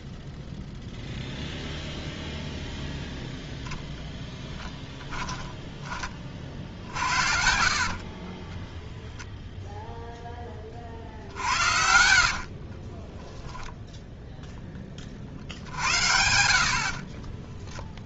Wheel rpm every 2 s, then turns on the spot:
0, 0, 10, 50, 20, 40, 50, 10, 80.
4-10 12-14